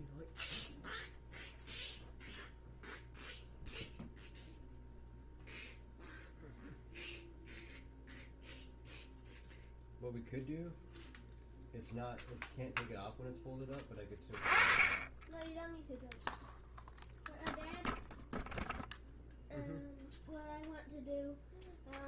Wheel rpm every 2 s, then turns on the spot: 0, 0, 0, 0, 0, 0, 0, 10, 0, 0, 0.
none